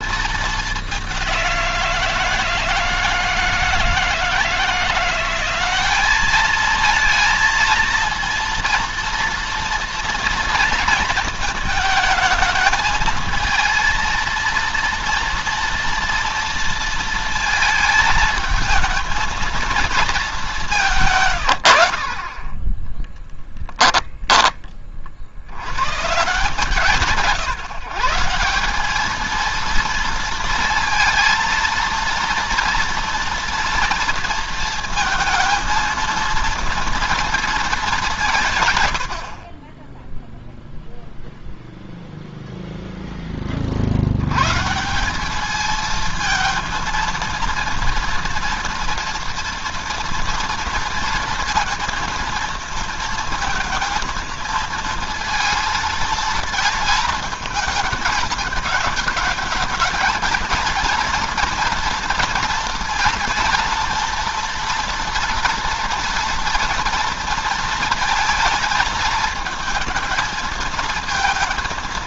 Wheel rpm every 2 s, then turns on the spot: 200, 160, 170, 220, 230, 230, 220, 230, 230, 220, 180, 20, 40, 160, 190, 230, 230, 230, 230, 130, 0, 0, 160, 230, 240, 230, 230, 230, 220, 210, 230, 230, 230, 230, 230, 220.
22-24